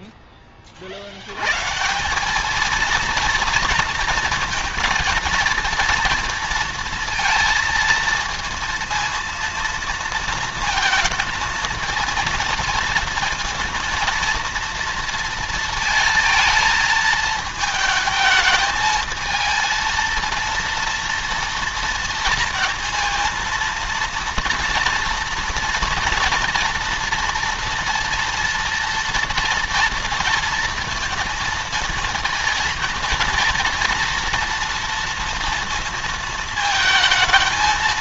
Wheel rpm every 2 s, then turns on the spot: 30, 220, 230, 230, 230, 230, 230, 230, 220, 220, 230, 230, 230, 230, 230, 230, 230, 230, 220.
none